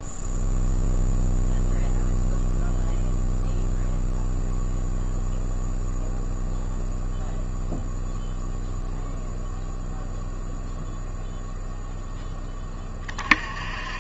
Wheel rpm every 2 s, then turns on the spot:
0, 0, 0, 0, 0, 0, 20.
none